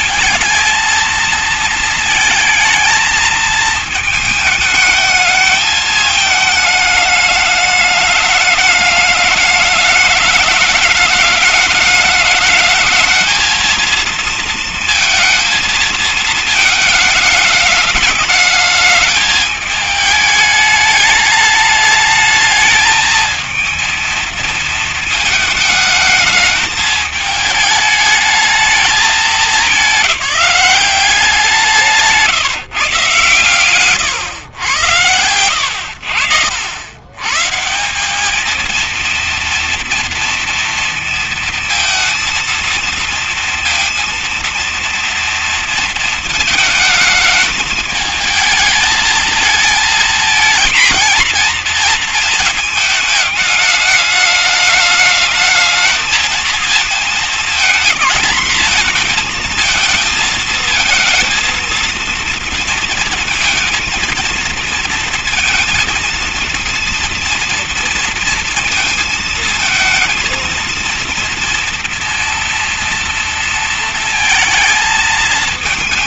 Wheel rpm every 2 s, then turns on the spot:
230, 220, 220, 220, 210, 220, 220, 230, 220, 210, 210, 210, 220, 220, 220, 190, 160, 110, 70, 210, 230, 230, 230, 220, 220, 220, 220, 210, 230, 230, 220, 230, 230, 230, 230, 230, 230, 230.
none